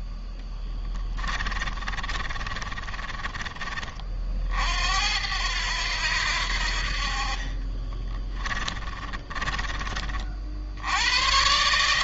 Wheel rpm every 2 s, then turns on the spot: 20, 30, 70, 50, 20, 100.
0-4 6-10